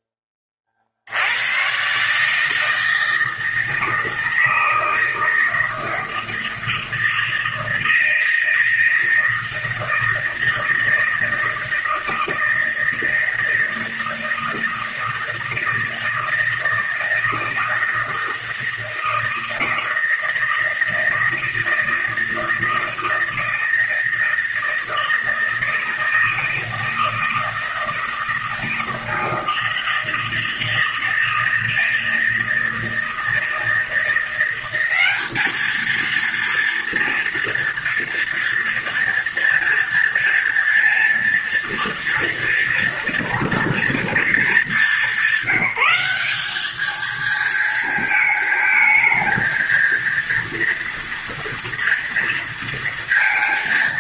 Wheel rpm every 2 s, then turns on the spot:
50, 160, 160, 160, 160, 160, 160, 160, 160, 160, 160, 160, 160, 160, 160, 160, 160, 200, 230, 230, 230, 230, 200, 220, 220, 230, 230.
none